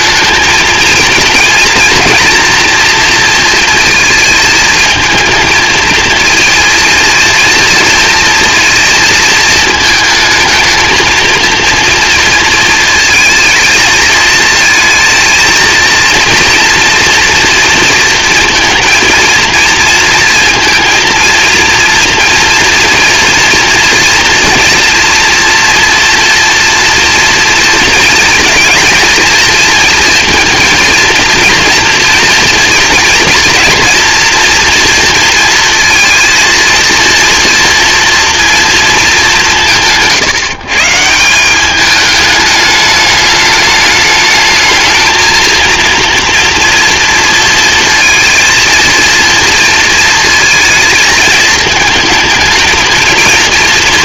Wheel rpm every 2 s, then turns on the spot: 230, 230, 220, 230, 220, 220, 230, 220, 230, 230, 220, 230, 240, 230, 230, 230, 230, 230, 230, 220, 160, 210, 220, 230, 230, 220, 220.
none